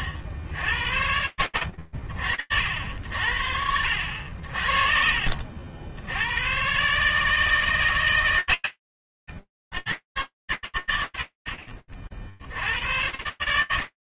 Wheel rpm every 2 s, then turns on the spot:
70, 70, 60, 150, 90, 80, 100.
none